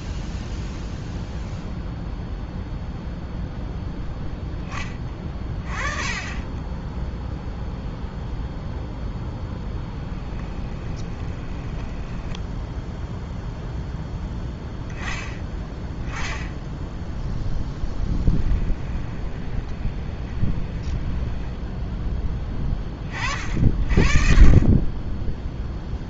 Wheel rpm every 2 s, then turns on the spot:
0, 0, 10, 10, 0, 20, 0, 10, 10, 10, 20, 20, 20.
10-12 18-22